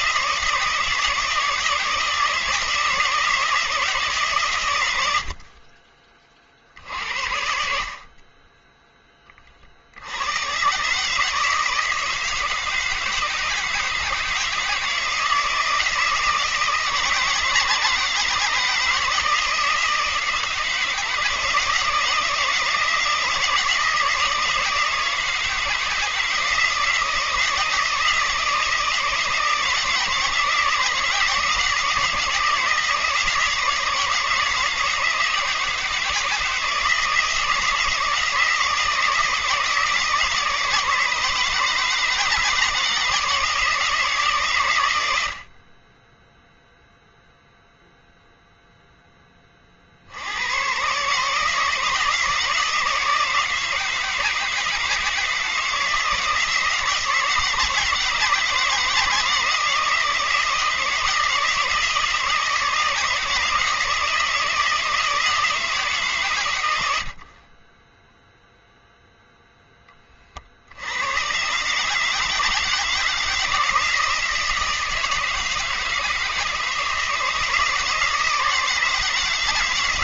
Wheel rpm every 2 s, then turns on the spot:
170, 160, 110, 60, 10, 120, 160, 160, 170, 160, 160, 170, 160, 170, 160, 170, 160, 160, 160, 160, 150, 160, 120, 0, 0, 120, 160, 160, 160, 160, 160, 160, 160, 100, 0, 70, 160, 160, 160, 160.
none